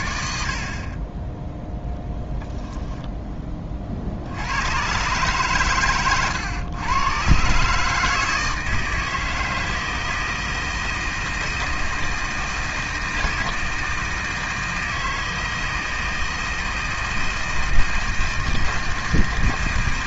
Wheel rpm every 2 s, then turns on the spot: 40, 10, 120, 120, 160, 160, 160, 160, 160, 160.
none